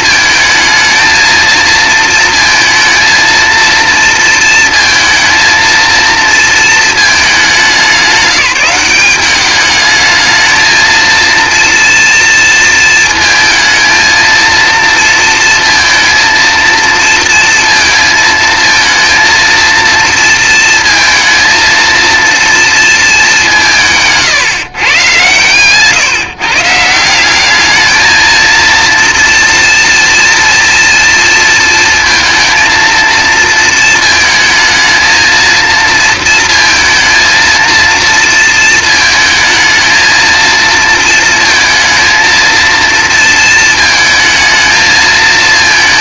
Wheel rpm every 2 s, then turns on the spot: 230, 230, 220, 220, 200, 230, 230, 230, 230, 220, 230, 220, 130, 170, 230, 230, 230, 220, 230, 220, 230, 230, 220.
none